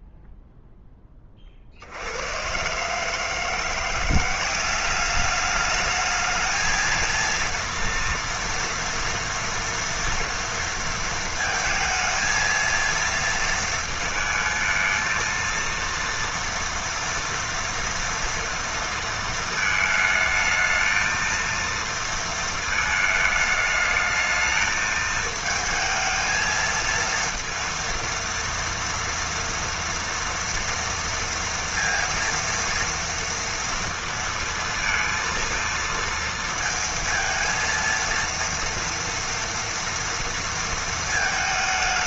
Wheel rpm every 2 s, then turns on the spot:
0, 130, 190, 220, 230, 230, 230, 220, 230, 230, 220, 220, 220, 220, 230, 230, 230, 230, 230, 230, 230.
none